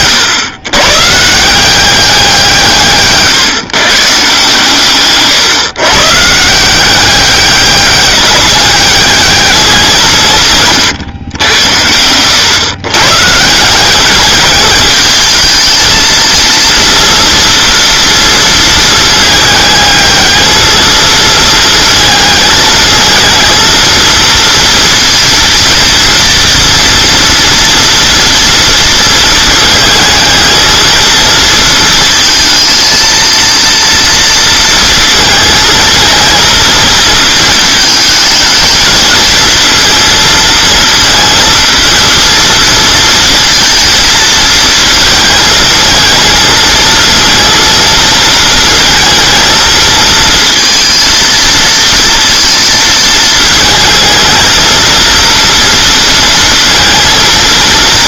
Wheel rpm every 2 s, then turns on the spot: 120, 170, 140, 170, 190, 140, 110, 200, 230, 230, 220, 220, 230, 230, 230, 220, 230, 230, 230, 220, 230, 230, 230, 220, 230, 230, 230, 230, 230.
none